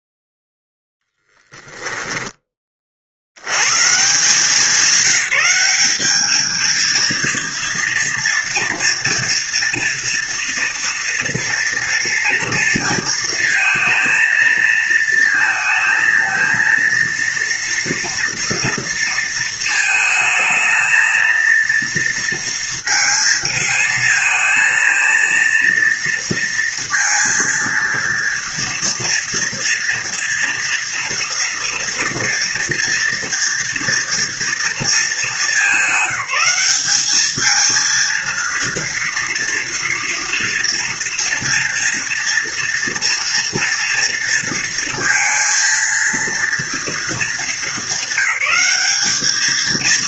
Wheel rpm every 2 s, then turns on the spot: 0, 30, 180, 230, 230, 230, 230, 230, 230, 230, 220, 230, 230, 230, 230, 230, 240, 230, 200, 230, 230, 230, 230, 230, 210.
none